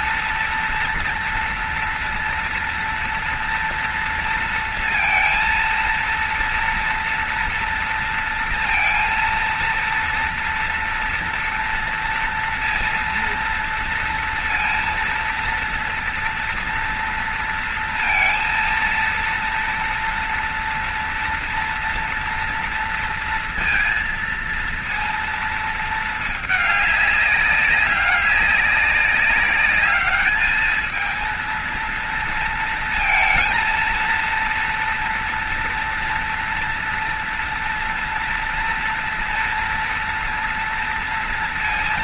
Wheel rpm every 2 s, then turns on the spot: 230, 230, 230, 230, 230, 240, 230, 230, 230, 230, 230, 230, 230, 220, 200, 210, 230, 230, 230, 230, 230.
none